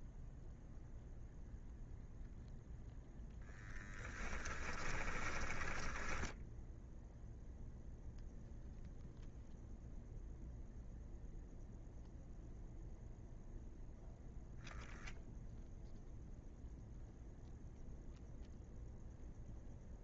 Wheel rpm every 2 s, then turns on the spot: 0, 0, 10, 0, 0, 0, 0, 0, 0, 0.
4-6